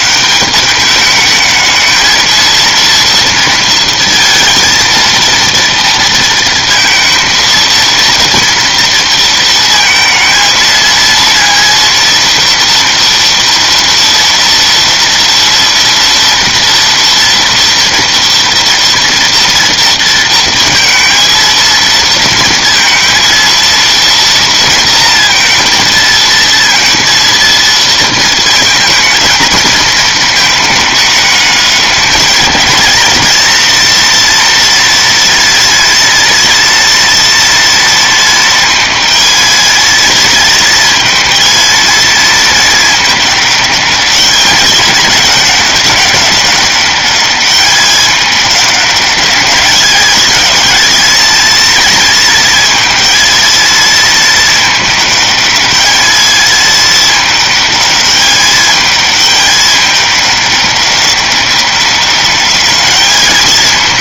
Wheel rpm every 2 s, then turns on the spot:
200, 230, 230, 230, 230, 230, 230, 230, 230, 230, 230, 230, 230, 230, 220, 220, 210, 240, 230, 220, 220, 220, 210, 200, 200, 220, 220, 220, 220, 210, 210, 210.
none